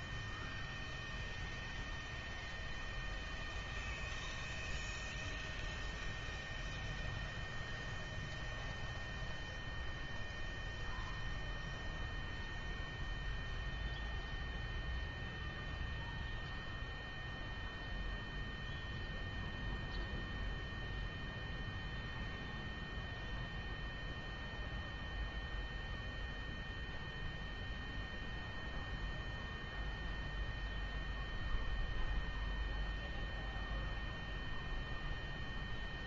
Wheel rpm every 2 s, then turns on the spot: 0, 0, 0, 0, 0, 0, 0, 0, 0, 0, 0, 0, 0, 0, 0, 0, 0, 0.
none